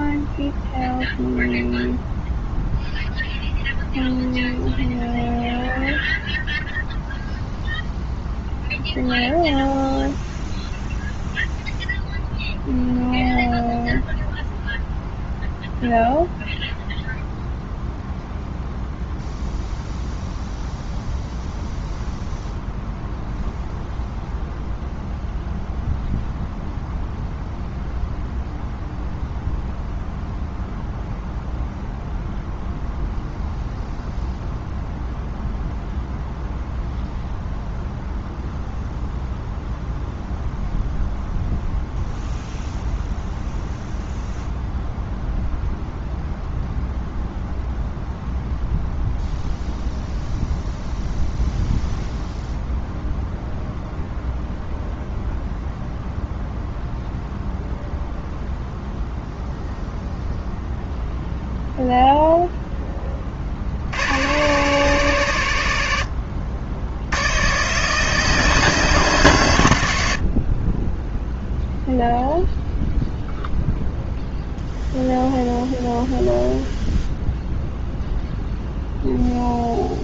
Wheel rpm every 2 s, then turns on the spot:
0, 0, 0, 0, 0, 0, 0, 0, 0, 0, 0, 0, 0, 0, 0, 0, 0, 0, 0, 0, 0, 0, 0, 0, 0, 0, 0, 0, 0, 0, 0, 10, 120, 70, 160, 20, 0, 0, 0, 0.
none